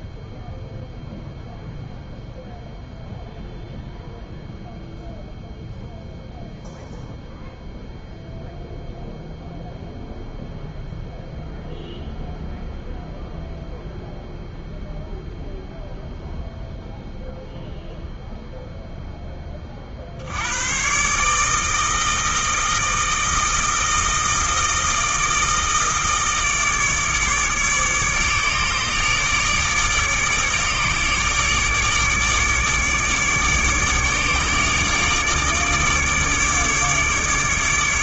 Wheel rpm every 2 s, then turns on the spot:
0, 0, 0, 0, 0, 0, 0, 0, 0, 0, 120, 160, 160, 150, 150, 150, 150, 150, 150.
none